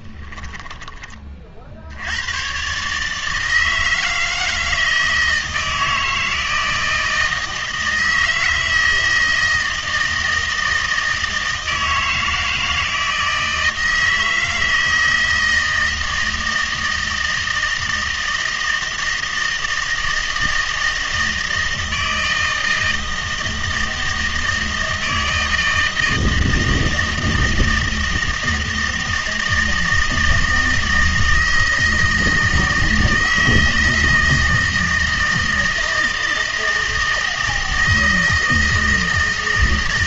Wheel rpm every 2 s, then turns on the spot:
10, 120, 160, 160, 160, 160, 160, 160, 160, 160, 160, 160, 160, 160, 160, 160, 160, 160, 160, 160.
0-2